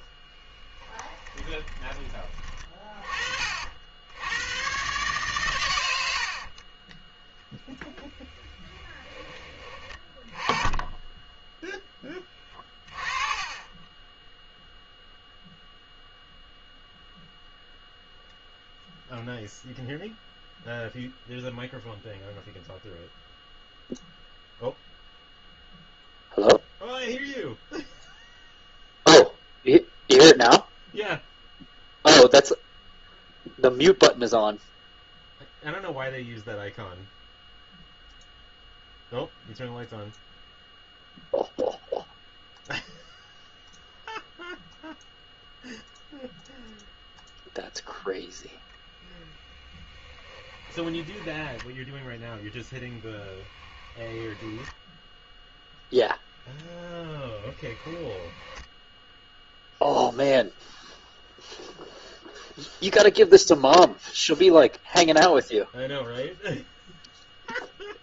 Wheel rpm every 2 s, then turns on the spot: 10, 30, 120, 30, 10, 20, 30, 0, 0, 0, 0, 0, 0, 0, 0, 0, 0, 0, 0, 0, 0, 0, 0, 0, 0, 10, 10, 10, 10, 10, 0, 0, 0, 0.
0-2 6-10 12-14 50-54 56-60